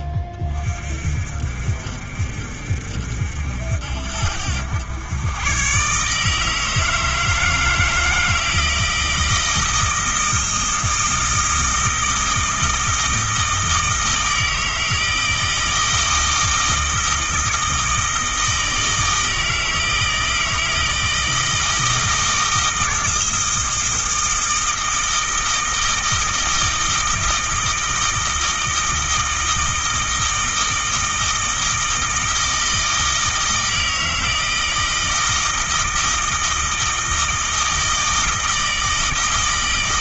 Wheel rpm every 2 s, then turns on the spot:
40, 60, 90, 160, 160, 160, 160, 160, 160, 160, 160, 160, 160, 160, 160, 160, 160, 160, 160, 160.
none